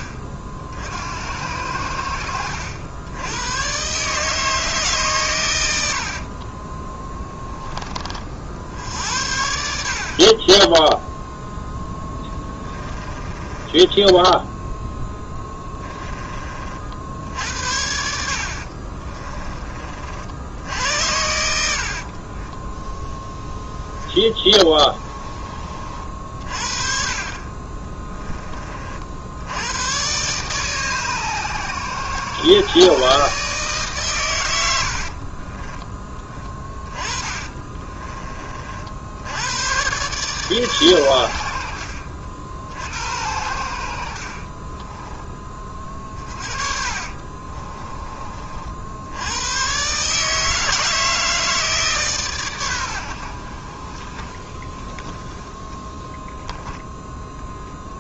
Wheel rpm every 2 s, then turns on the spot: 60, 80, 150, 30, 60, 20, 20, 10, 50, 60, 70, 20, 20, 40, 30, 140, 130, 100, 20, 40, 130, 60, 30, 40, 50, 160, 120, 20, 10.
6-8 12-16 18-20 24-26 34-38 44-48